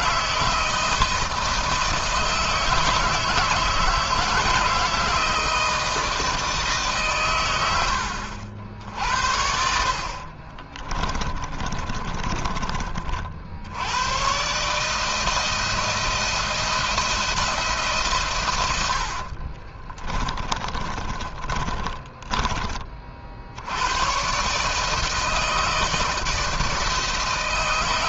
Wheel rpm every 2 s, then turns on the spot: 160, 160, 160, 130, 70, 20, 50, 160, 170, 80, 20, 40, 160, 160.
10-12 18-22